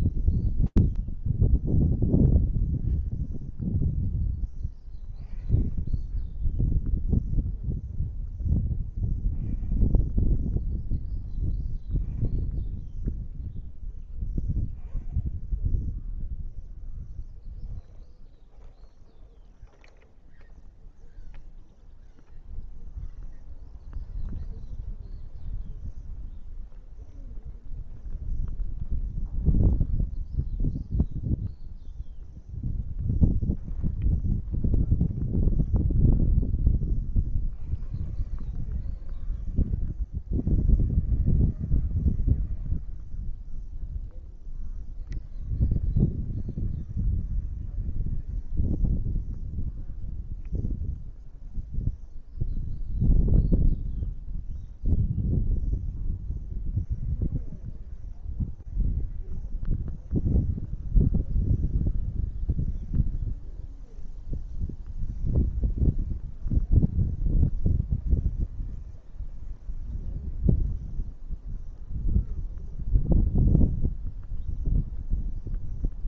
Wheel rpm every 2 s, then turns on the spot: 0, 0, 0, 0, 0, 0, 0, 0, 0, 0, 0, 0, 0, 0, 0, 0, 0, 0, 0, 0, 0, 0, 0, 0, 0, 0, 0, 0, 0, 0, 0, 0, 0, 0, 0, 0, 0, 0.
none